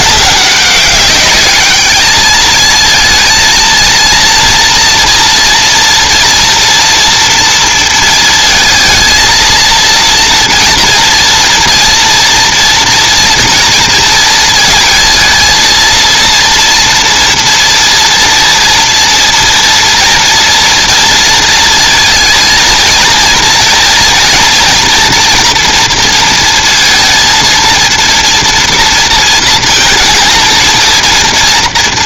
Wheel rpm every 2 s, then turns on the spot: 210, 230, 240, 230, 230, 230, 230, 230, 230, 230, 230, 230, 230, 230, 230, 230.
none